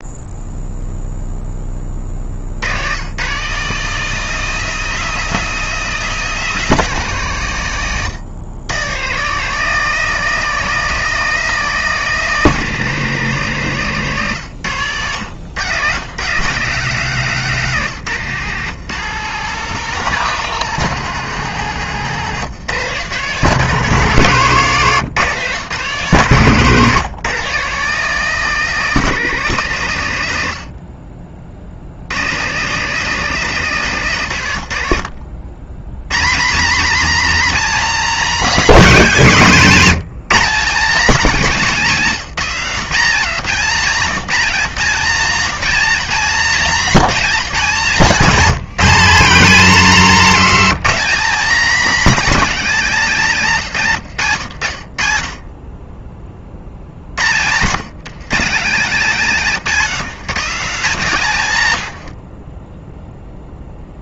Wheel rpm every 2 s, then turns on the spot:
0, 100, 190, 170, 130, 190, 180, 110, 160, 160, 180, 140, 140, 140, 180, 60, 160, 80, 240, 240, 230, 200, 200, 220, 220, 240, 230, 80, 80, 180, 190, 10.
14-16 60-64